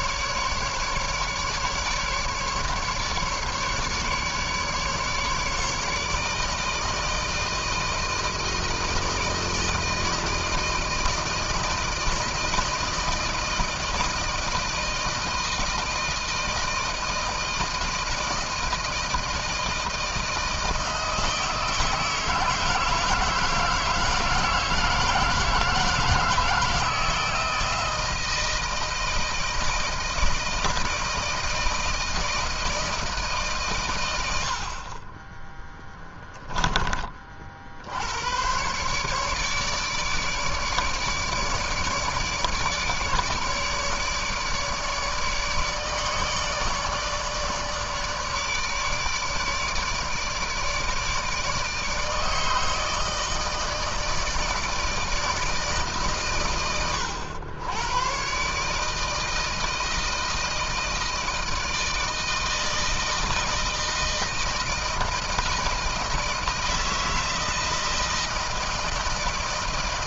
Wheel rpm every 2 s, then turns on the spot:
150, 150, 150, 160, 170, 160, 160, 160, 160, 160, 160, 160, 160, 160, 160, 160, 160, 70, 10, 110, 150, 150, 150, 150, 150, 150, 160, 160, 120, 130, 160, 160, 160, 160, 160.
34-36